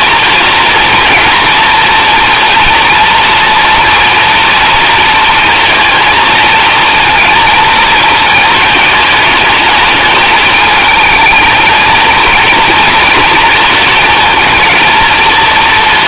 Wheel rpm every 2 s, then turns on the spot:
230, 230, 230, 220, 220, 220, 230, 230.
none